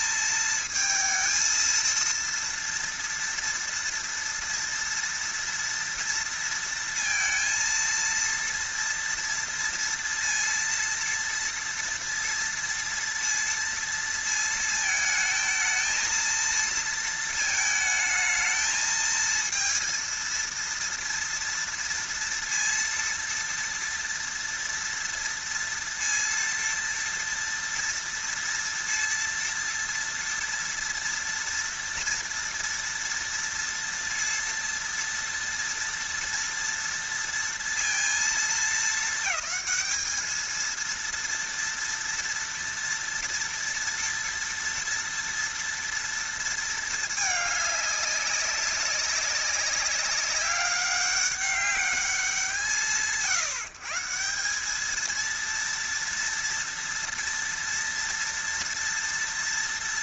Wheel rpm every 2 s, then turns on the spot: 230, 230, 230, 230, 230, 230, 230, 220, 230, 220, 230, 230, 230, 230, 230, 230, 230, 230, 230, 220, 220, 230, 230, 230, 200, 200, 150, 190, 230, 230.
none